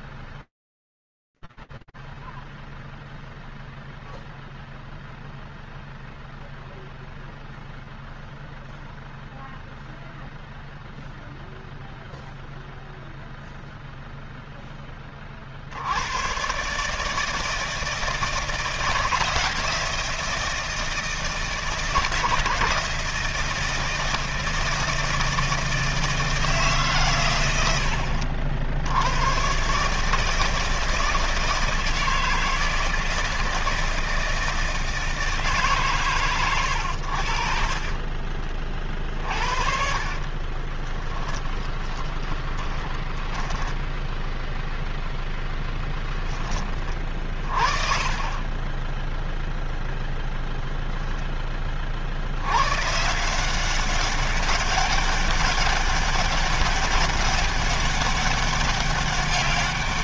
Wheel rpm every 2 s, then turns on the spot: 0, 0, 0, 0, 0, 0, 0, 0, 100, 160, 160, 160, 160, 150, 70, 160, 160, 160, 110, 40, 30, 10, 0, 30, 10, 10, 110, 200, 200, 200.
38-44 48-50